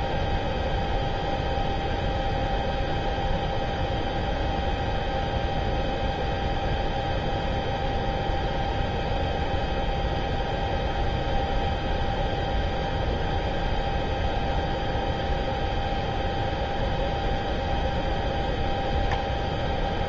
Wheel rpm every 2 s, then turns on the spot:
0, 0, 0, 0, 0, 0, 0, 0, 0, 0.
none